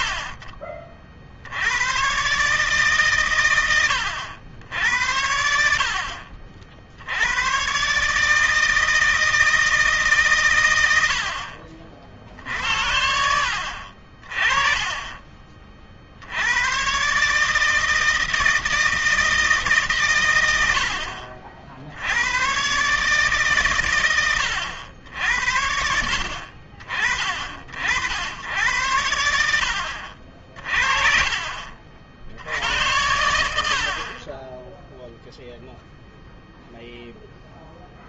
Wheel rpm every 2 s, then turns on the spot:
50, 140, 80, 60, 160, 110, 60, 30, 110, 160, 90, 120, 80, 60, 100, 60, 80, 10, 0.
none